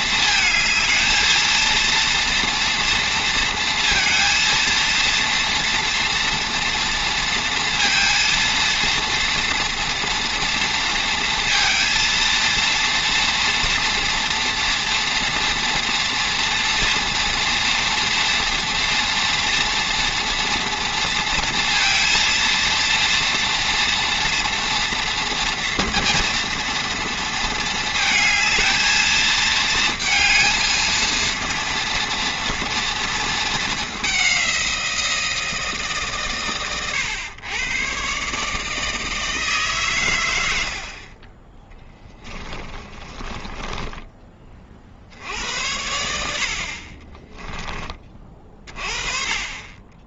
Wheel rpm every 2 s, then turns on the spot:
220, 230, 230, 230, 230, 230, 230, 240, 230, 230, 230, 230, 240, 230, 220, 230, 230, 170, 120, 160, 60, 30, 50, 40, 40.
40-44